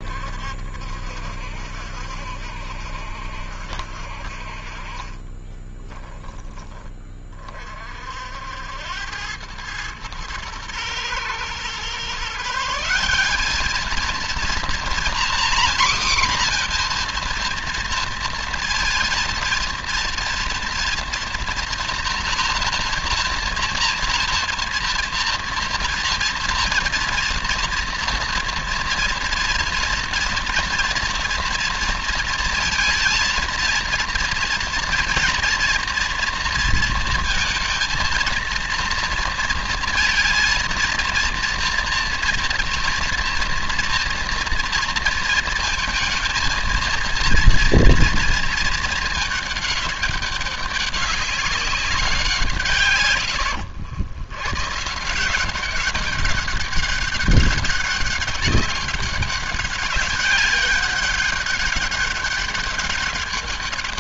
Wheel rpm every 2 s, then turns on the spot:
60, 70, 40, 20, 80, 110, 160, 240, 240, 230, 230, 230, 230, 230, 230, 230, 230, 230, 230, 230, 230, 230, 230, 230, 220, 200, 110, 130, 190, 200, 190, 190.
4-6